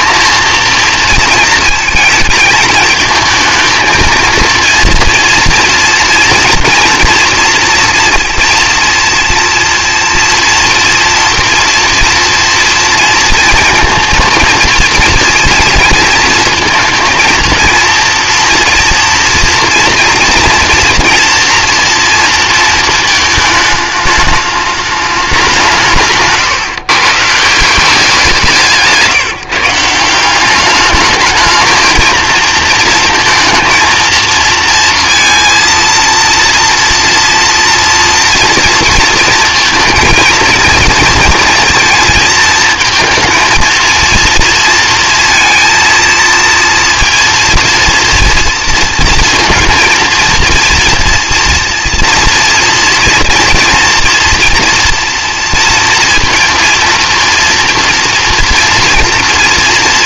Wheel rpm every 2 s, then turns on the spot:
230, 230, 230, 230, 230, 230, 230, 230, 230, 240, 230, 230, 210, 140, 170, 200, 230, 230, 240, 230, 230, 220, 230, 230, 230, 230, 230, 230, 230, 230.
none